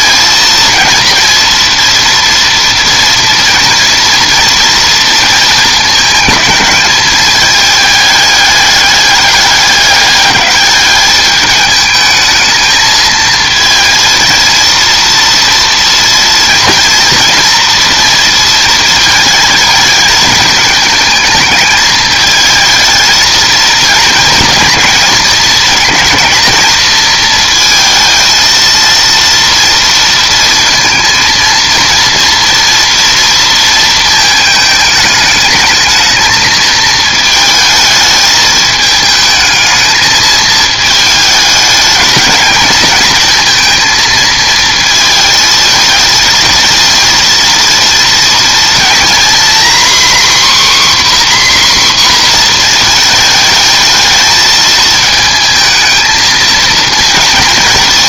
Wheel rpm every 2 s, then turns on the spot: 230, 230, 230, 210, 210, 210, 220, 230, 230, 230, 220, 220, 220, 220, 230, 230, 230, 220, 220, 220, 220, 220, 230, 220, 230, 270, 240, 220, 230.
none